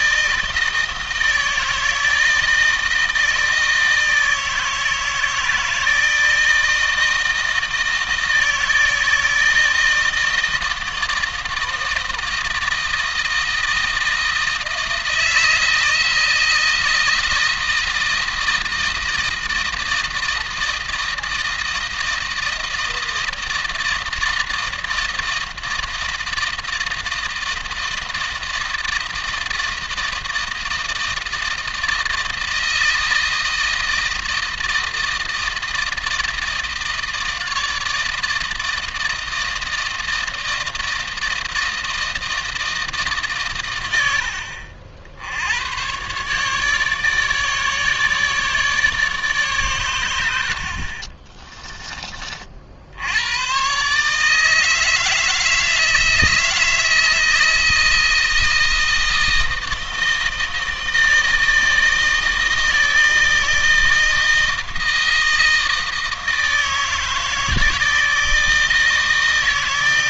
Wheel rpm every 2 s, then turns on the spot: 160, 160, 160, 160, 160, 160, 160, 160, 160, 160, 160, 160, 160, 160, 160, 160, 160, 160, 160, 160, 160, 160, 70, 150, 150, 50, 70, 160, 160, 160, 160, 160, 160, 160, 160.
none